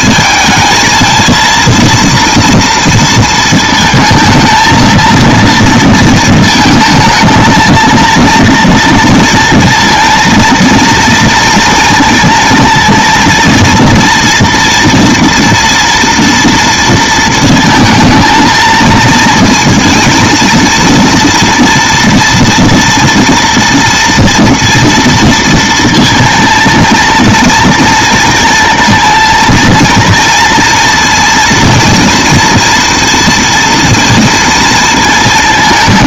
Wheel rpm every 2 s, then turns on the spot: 220, 230, 220, 220, 230, 230, 230, 230, 230, 230, 230, 230, 230, 230, 230, 230, 230, 230.
none